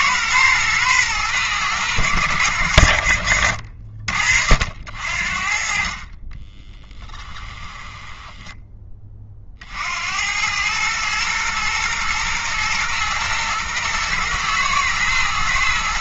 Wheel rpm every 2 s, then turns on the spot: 110, 70, 60, 20, 20, 110, 120, 120.
6-8